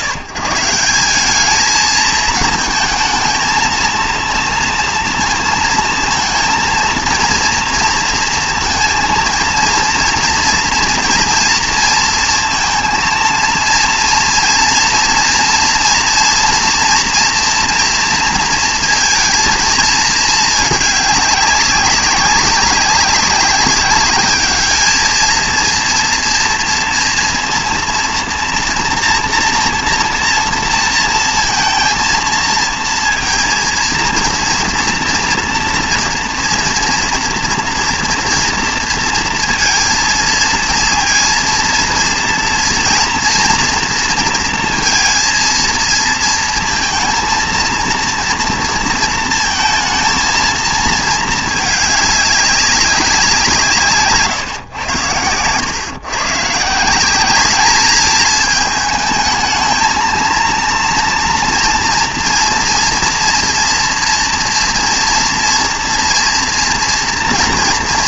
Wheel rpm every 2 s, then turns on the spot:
170, 220, 230, 230, 230, 240, 230, 230, 230, 230, 210, 200, 210, 230, 230, 230, 230, 240, 230, 230, 230, 230, 230, 230, 230, 230, 200, 130, 140, 220, 230, 240, 230, 230.
none